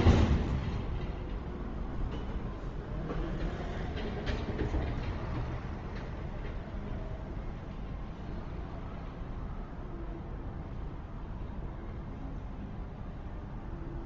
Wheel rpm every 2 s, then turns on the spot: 0, 0, 0, 0, 0, 0, 0.
none